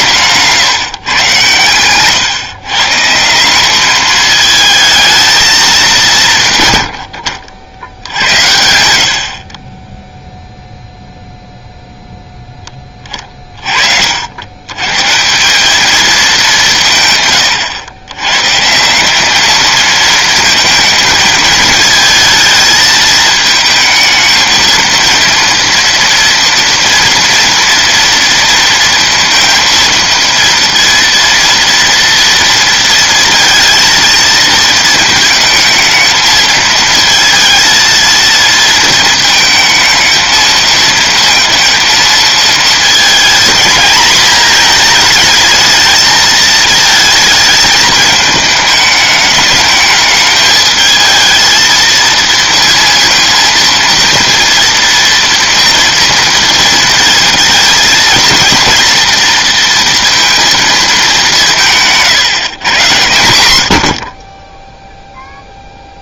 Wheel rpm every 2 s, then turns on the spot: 140, 140, 220, 120, 70, 0, 20, 120, 170, 160, 220, 220, 220, 230, 230, 230, 230, 220, 220, 230, 220, 220, 220, 220, 210, 220, 230, 230, 230, 230, 220, 120, 0.
none